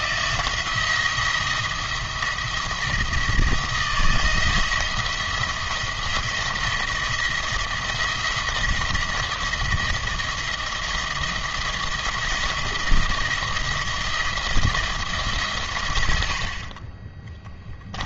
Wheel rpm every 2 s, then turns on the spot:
170, 170, 170, 170, 170, 170, 170, 170, 40.
none